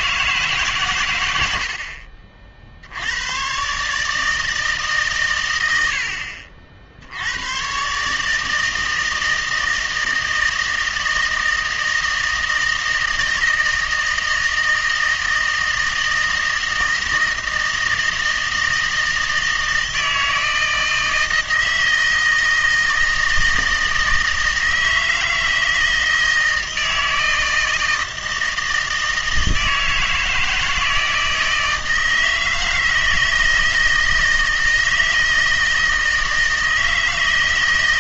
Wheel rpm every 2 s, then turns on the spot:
140, 60, 150, 50, 160, 160, 160, 160, 160, 160, 160, 160, 160, 160, 160, 160, 160, 160, 160.
none